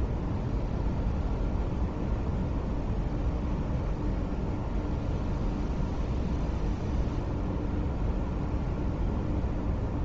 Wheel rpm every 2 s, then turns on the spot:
0, 0, 0, 0, 0.
none